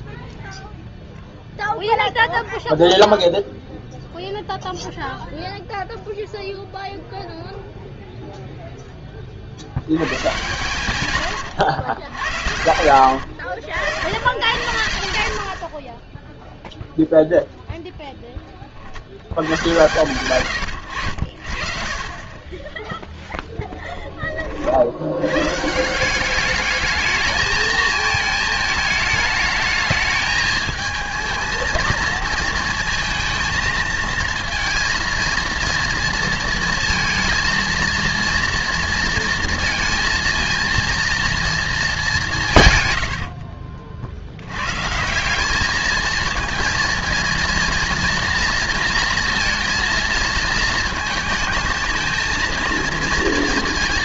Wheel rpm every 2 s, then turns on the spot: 0, 0, 0, 0, 0, 120, 80, 90, 0, 50, 90, 10, 50, 210, 220, 220, 220, 230, 230, 230, 230, 130, 130, 230, 230, 230, 230.
20-22